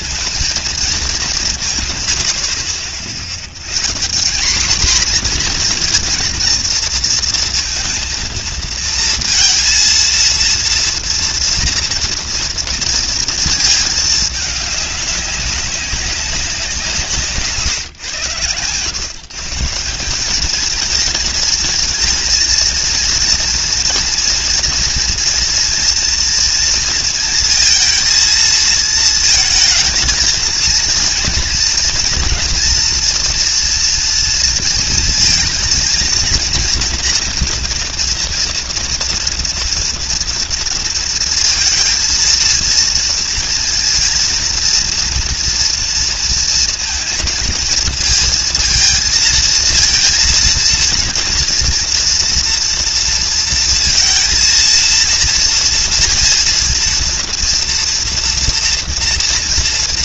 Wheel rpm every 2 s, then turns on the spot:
220, 70, 240, 230, 230, 230, 230, 200, 170, 130, 230, 230, 230, 230, 220, 230, 230, 230, 230, 230, 230, 230, 230, 230, 230, 230, 230, 230, 230, 240.
none